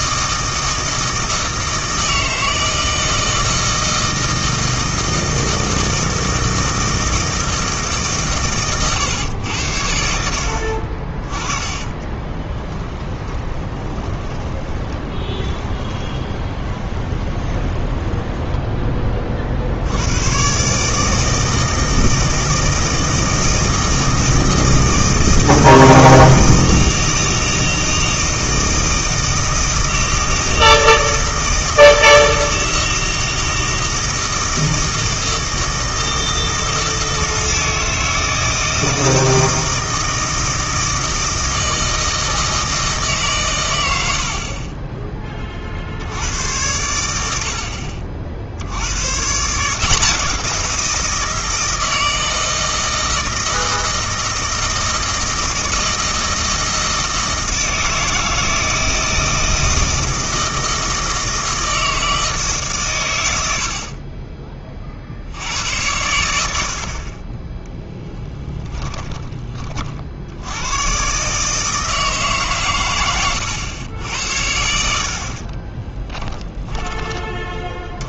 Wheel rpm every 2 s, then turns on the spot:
160, 160, 160, 160, 120, 60, 20, 20, 20, 10, 140, 160, 160, 160, 160, 160, 160, 160, 160, 160, 160, 160, 30, 90, 80, 170, 160, 160, 160, 160, 160, 140, 30, 80, 10, 110, 130, 80, 20.
12-18 44-46 76-78